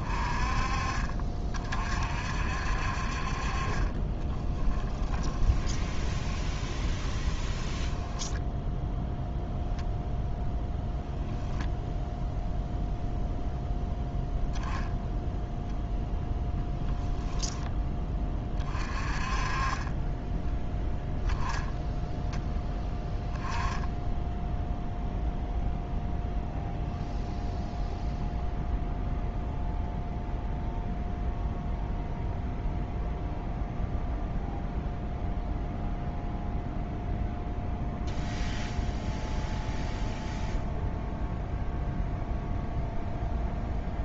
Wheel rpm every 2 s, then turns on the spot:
40, 50, 10, 20, 0, 0, 0, 0, 10, 30, 10, 10, 0, 0, 0, 0, 0, 0, 0, 0, 0, 0.
4-8 16-18